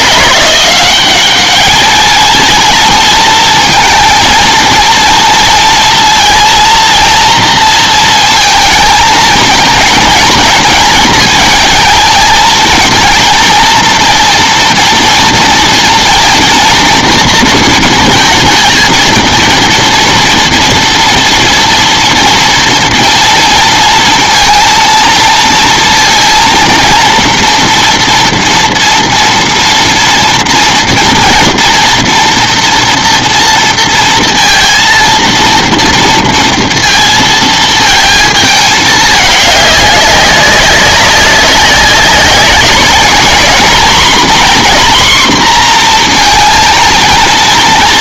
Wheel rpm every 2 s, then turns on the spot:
170, 220, 230, 230, 230, 220, 220, 230, 230, 230, 240, 230, 230, 230, 230, 230, 240, 230, 230, 220, 190, 190, 250, 230.
none